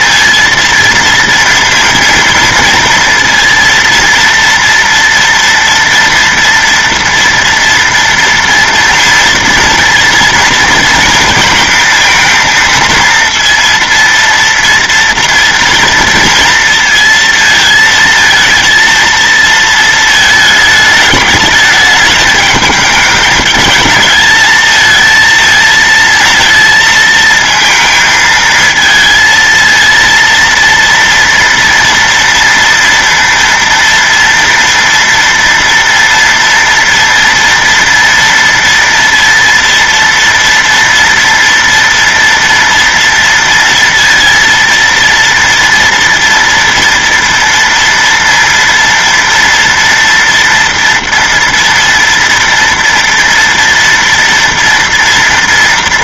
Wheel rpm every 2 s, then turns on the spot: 230, 230, 230, 230, 230, 230, 230, 230, 230, 230, 210, 210, 220, 230, 220, 230, 230, 230, 230, 230, 230, 230, 230, 230, 230, 230, 230, 230.
none